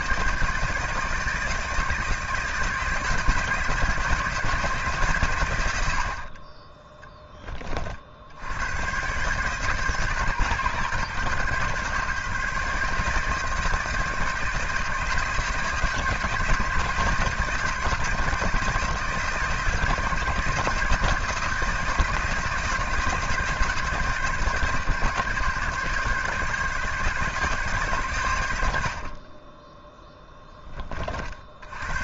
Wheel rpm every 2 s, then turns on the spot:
160, 160, 150, 20, 110, 140, 150, 160, 160, 160, 160, 160, 140, 150, 80, 20.
none